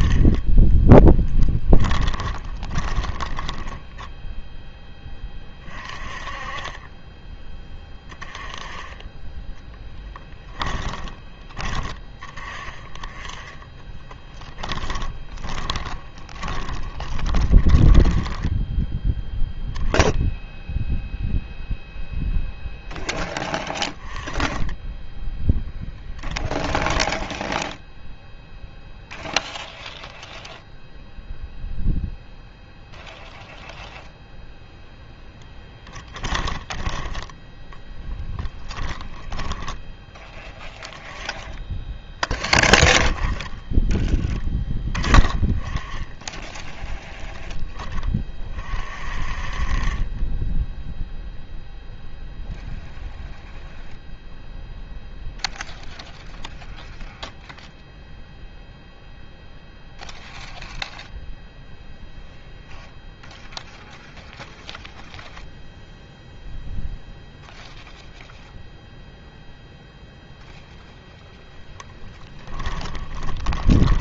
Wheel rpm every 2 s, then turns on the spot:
10, 20, 10, 30, 20, 10, 20, 10, 20, 10, 0, 0, 10, 10, 0, 0, 0, 0, 20, 10, 10, 20, 10, 10, 30, 10, 0, 0, 0, 0, 0, 0, 0, 0, 0, 0, 10.
0-4 6-8 10-12 14-18 26-28 36-40 72-74